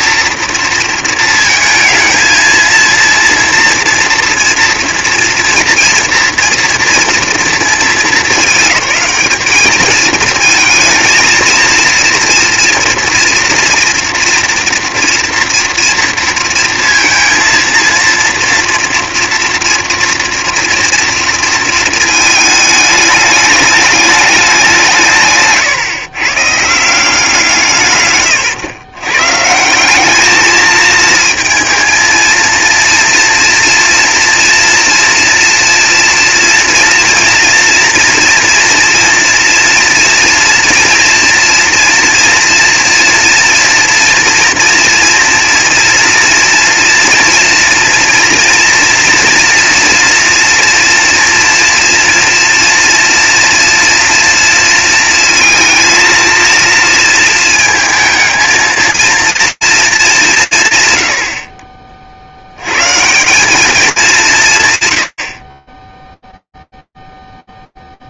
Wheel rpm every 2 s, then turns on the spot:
220, 240, 240, 220, 220, 230, 230, 230, 230, 230, 230, 210, 120, 130, 180, 220, 230, 230, 230, 240, 230, 230, 230, 230, 230, 230, 230, 230, 230, 220, 30, 210, 30, 0.
none